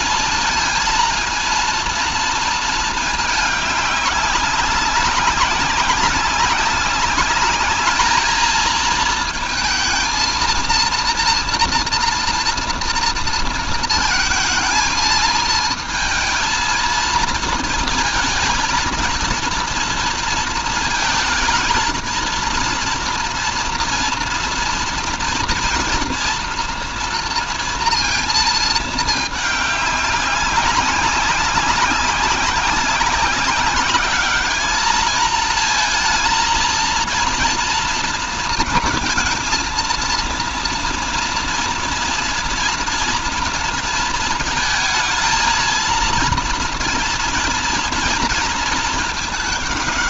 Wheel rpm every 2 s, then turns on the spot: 230, 230, 190, 200, 220, 230, 230, 220, 230, 220, 230, 230, 230, 230, 220, 200, 190, 220, 230, 230, 230, 230, 220, 230, 220.
none